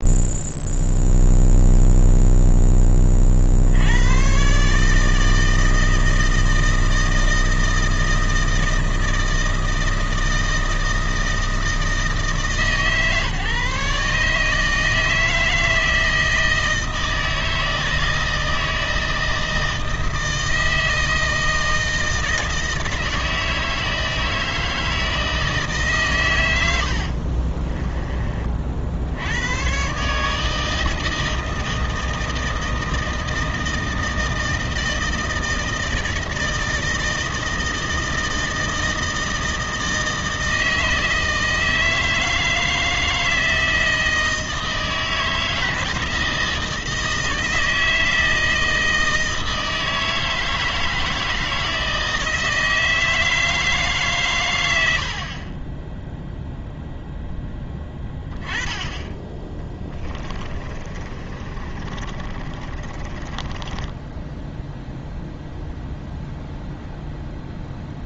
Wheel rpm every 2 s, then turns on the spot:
0, 10, 140, 160, 160, 160, 140, 160, 160, 160, 160, 160, 160, 90, 50, 160, 160, 160, 160, 160, 160, 160, 160, 160, 160, 160, 160, 80, 0, 20, 30, 40, 0, 0.
26-28 60-64